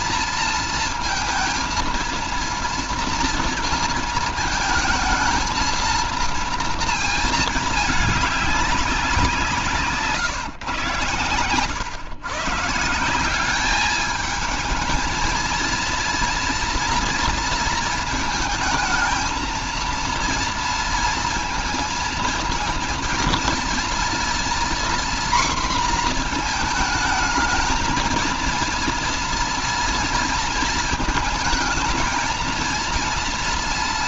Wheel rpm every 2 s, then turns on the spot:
230, 230, 220, 230, 190, 120, 150, 210, 230, 220, 230, 230, 240, 220, 230, 230, 230.
none